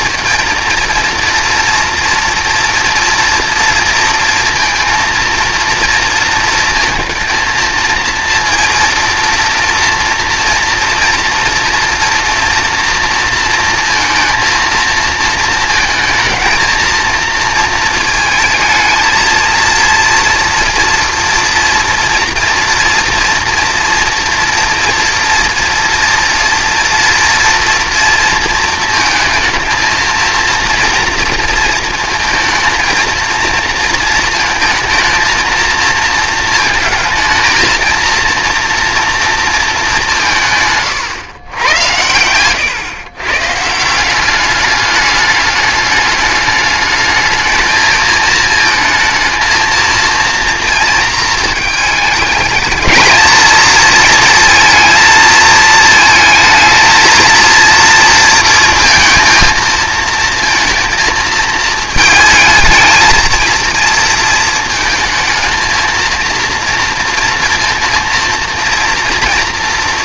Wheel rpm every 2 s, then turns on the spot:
230, 230, 230, 220, 230, 230, 230, 230, 230, 220, 240, 230, 230, 230, 230, 230, 220, 230, 220, 230, 140, 120, 200, 210, 220, 230, 210, 230, 220, 230, 220, 220, 230, 230, 230.
none